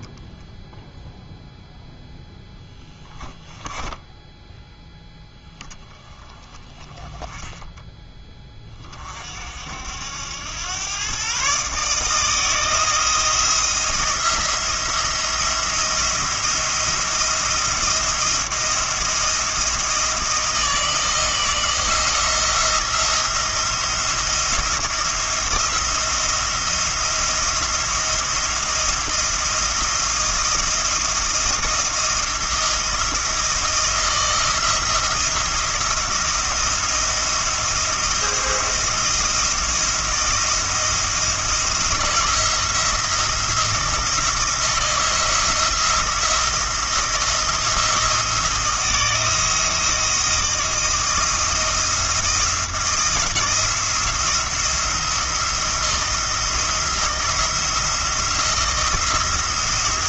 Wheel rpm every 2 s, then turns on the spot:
0, 10, 10, 20, 30, 120, 160, 170, 170, 170, 160, 170, 170, 170, 170, 170, 170, 170, 170, 170, 170, 160, 170, 170, 170, 160, 170, 170, 160, 160.
none